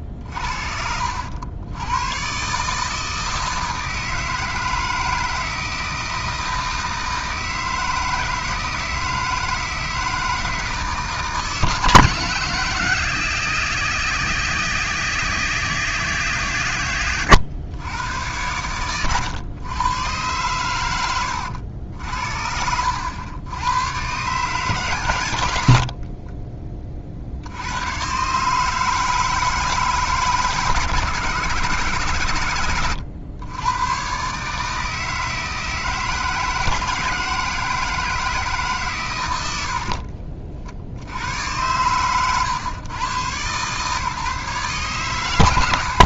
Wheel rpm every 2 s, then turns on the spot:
60, 140, 160, 160, 160, 160, 160, 160, 130, 100, 110, 70, 140, 30, 150, 150, 120, 150, 170, 140, 60, 130, 140.
none